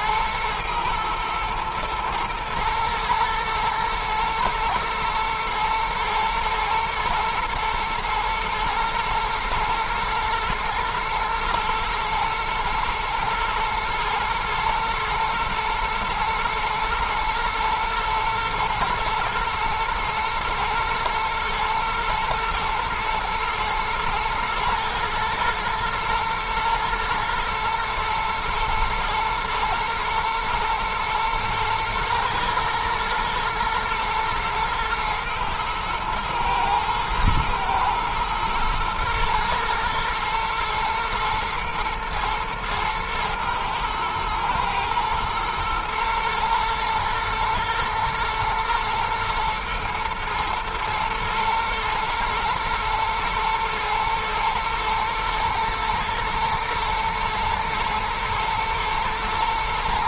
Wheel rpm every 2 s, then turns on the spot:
110, 110, 110, 110, 110, 110, 110, 110, 120, 120, 120, 120, 110, 110, 120, 120, 110, 110, 110, 120, 110, 110, 120, 110, 110, 110, 110, 120, 120, 120.
none